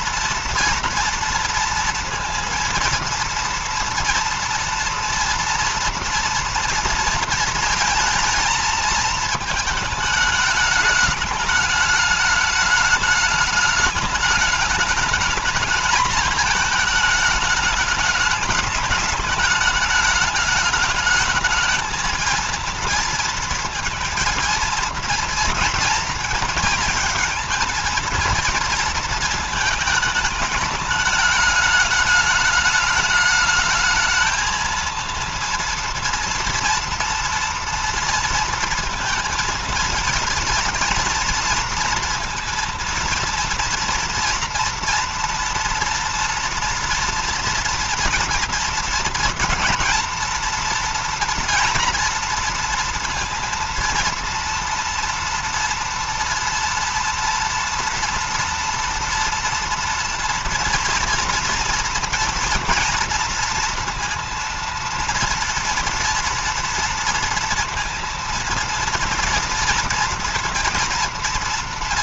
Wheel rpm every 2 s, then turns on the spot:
230, 230, 230, 230, 220, 210, 210, 210, 220, 210, 210, 230, 230, 220, 230, 210, 210, 230, 230, 230, 230, 230, 230, 230, 230, 230, 230, 230, 230, 230, 230, 230, 230, 230, 230, 230.
none